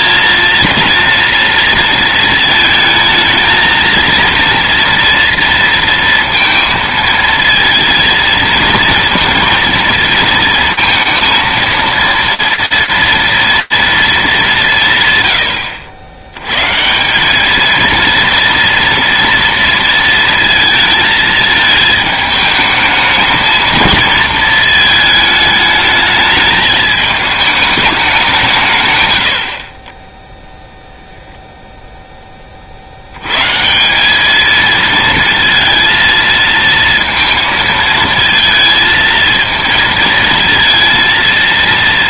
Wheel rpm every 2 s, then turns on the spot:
230, 220, 230, 230, 230, 230, 230, 160, 140, 230, 230, 220, 220, 210, 130, 0, 30, 220, 230, 230, 230.
none